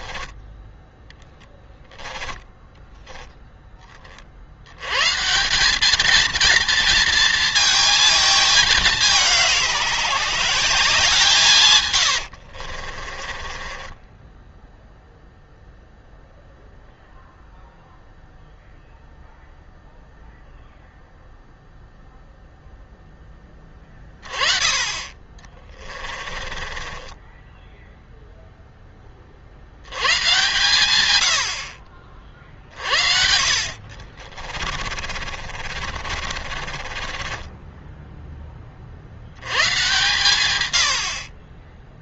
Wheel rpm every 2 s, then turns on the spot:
10, 10, 150, 230, 190, 160, 30, 0, 0, 0, 0, 0, 20, 30, 10, 120, 50, 40, 40, 30, 90.
0-2 12-14 24-28 34-38